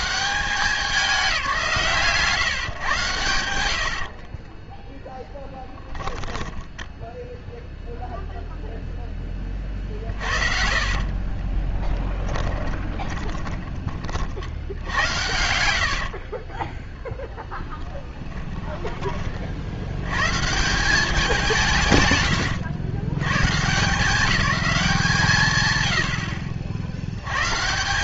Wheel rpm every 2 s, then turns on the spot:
190, 130, 10, 0, 0, 50, 30, 80, 10, 30, 190, 120, 190, 80.
4-6 10-14 16-20